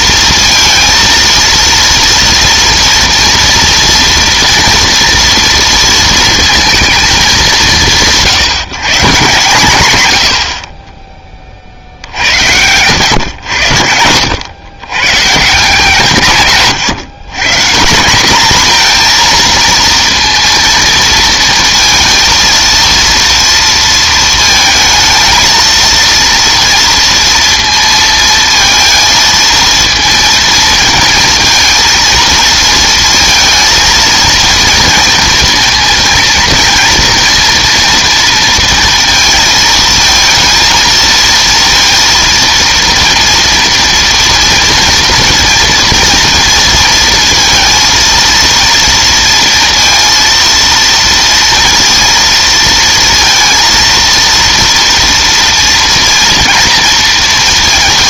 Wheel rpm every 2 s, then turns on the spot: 230, 230, 240, 230, 170, 50, 90, 110, 140, 230, 230, 230, 230, 230, 230, 230, 230, 230, 230, 230, 230, 230, 230, 230, 230, 230, 230, 230, 230.
16-18